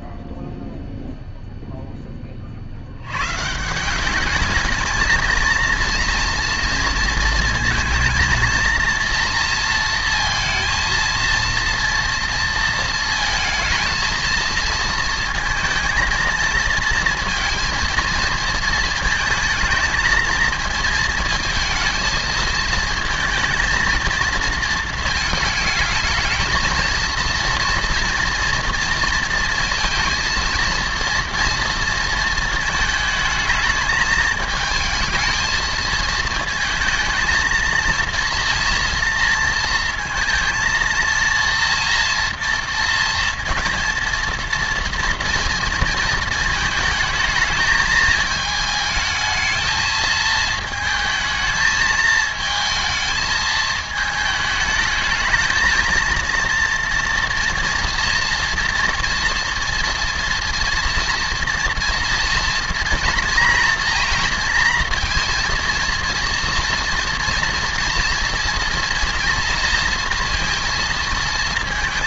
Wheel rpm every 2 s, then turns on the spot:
0, 60, 220, 230, 230, 230, 230, 230, 230, 220, 220, 220, 230, 220, 230, 230, 220, 220, 230, 230, 230, 230, 230, 220, 220, 220, 220, 220, 230, 230, 230, 230, 230, 230, 230, 230.
none